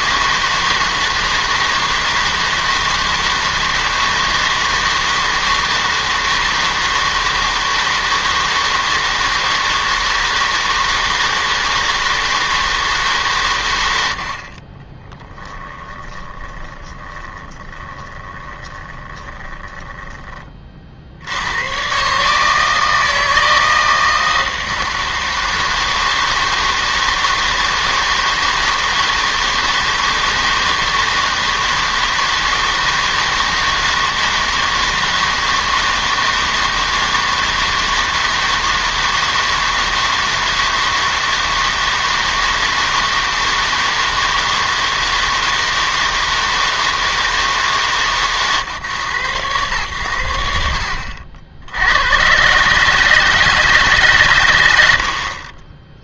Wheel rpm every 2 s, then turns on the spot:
160, 160, 160, 160, 160, 160, 160, 40, 20, 20, 30, 150, 160, 160, 160, 160, 160, 160, 160, 160, 160, 160, 160, 160, 130, 80, 150, 100.
16-20